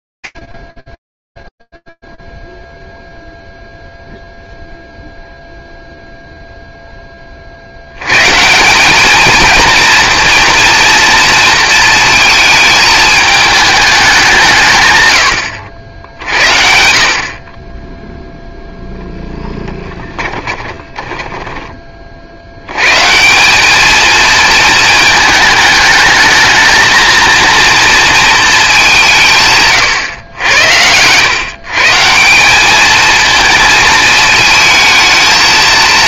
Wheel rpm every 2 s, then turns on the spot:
20, 0, 0, 0, 170, 240, 220, 150, 60, 0, 30, 140, 220, 230, 180, 100, 220, 220.
20-22